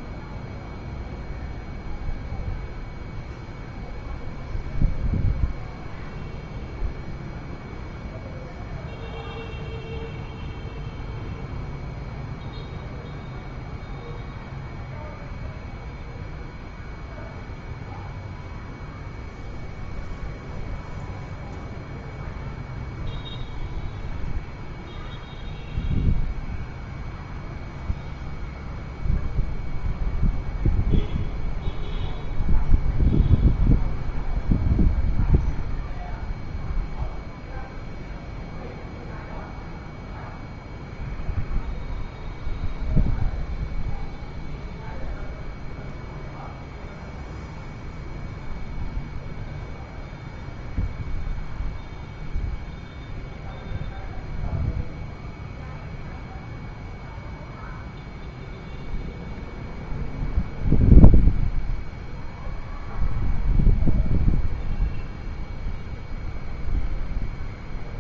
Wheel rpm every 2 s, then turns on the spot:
0, 0, 0, 0, 0, 0, 0, 0, 0, 0, 0, 0, 0, 0, 0, 0, 0, 0, 0, 0, 0, 0, 0, 0, 0, 0, 0, 0, 0, 0, 0, 0, 0, 0.
none